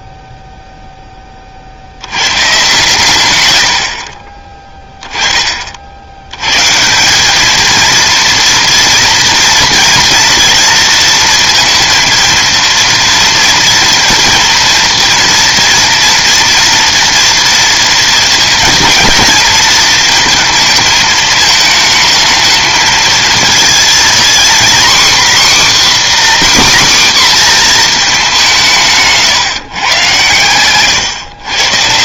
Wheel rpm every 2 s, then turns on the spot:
10, 120, 20, 200, 230, 230, 230, 230, 230, 230, 220, 230, 270, 250, 150, 120.
none